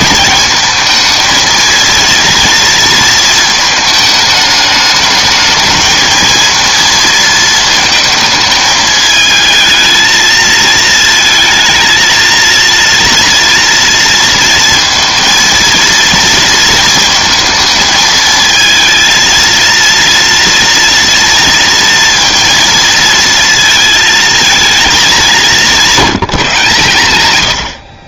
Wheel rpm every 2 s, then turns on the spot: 230, 230, 210, 230, 220, 230, 230, 230, 230, 220, 230, 230, 210, 130.
none